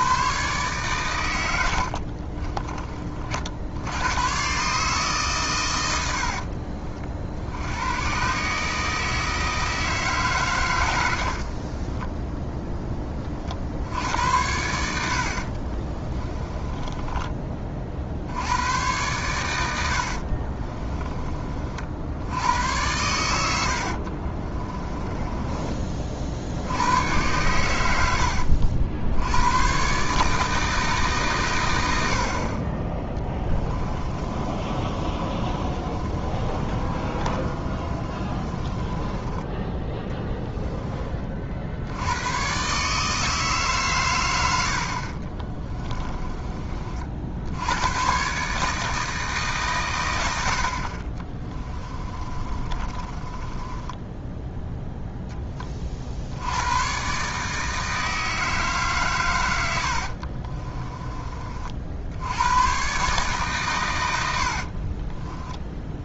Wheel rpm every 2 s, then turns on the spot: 120, 30, 140, 50, 150, 110, 20, 80, 20, 110, 30, 90, 20, 90, 70, 160, 30, 30, 30, 20, 10, 130, 70, 30, 160, 50, 30, 0, 90, 150, 30, 120, 70.
10-12 16-18 20-22 24-26 34-40 52-54 60-62 64-66